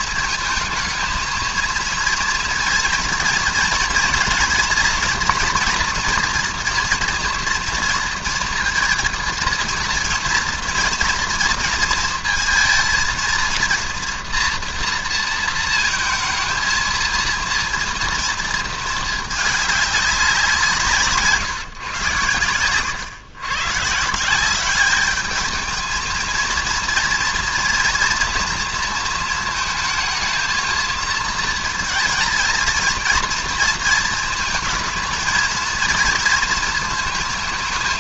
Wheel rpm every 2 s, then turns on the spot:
220, 230, 230, 240, 230, 230, 230, 230, 220, 230, 190, 110, 190, 230, 230, 220, 220, 230, 230.
none